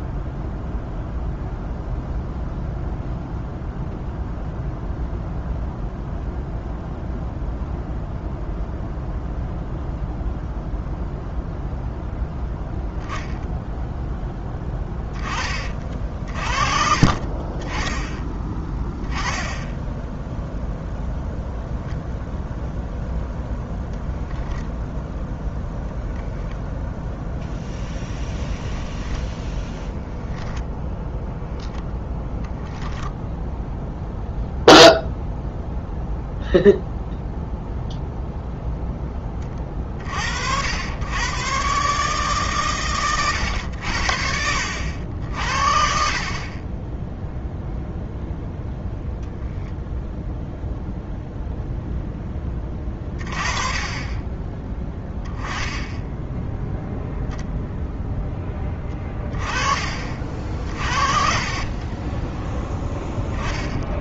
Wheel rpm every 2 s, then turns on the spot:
0, 0, 0, 0, 0, 0, 0, 10, 50, 10, 0, 0, 0, 10, 10, 10, 10, 0, 0, 0, 90, 130, 80, 20, 0, 0, 20, 10, 0, 20, 40, 0.
26-30 58-62